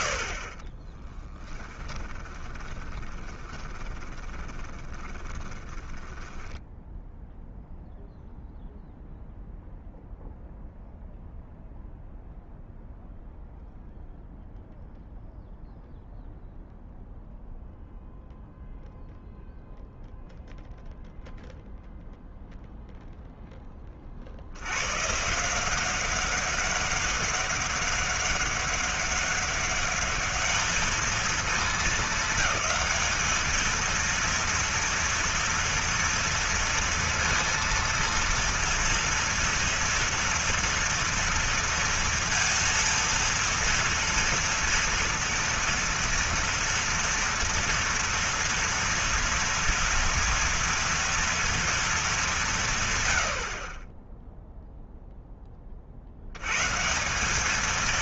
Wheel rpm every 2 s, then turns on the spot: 70, 20, 20, 10, 0, 0, 0, 0, 0, 0, 0, 0, 100, 200, 200, 220, 210, 230, 230, 230, 230, 230, 230, 230, 230, 230, 150, 0, 140.
2-6